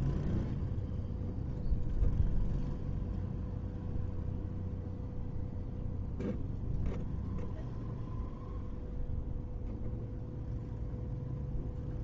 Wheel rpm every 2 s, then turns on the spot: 0, 0, 0, 0, 0, 0.
none